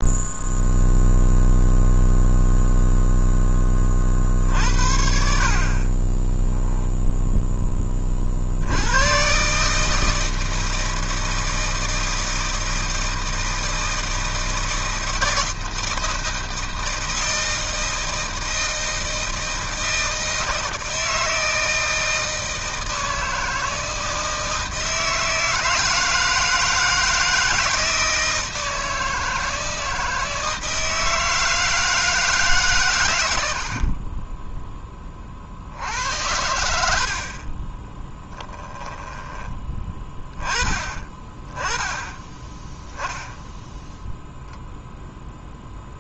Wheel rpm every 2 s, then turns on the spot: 0, 0, 60, 0, 100, 160, 160, 160, 160, 160, 160, 160, 160, 160, 160, 160, 130, 10, 70, 10, 20, 10, 0.
38-40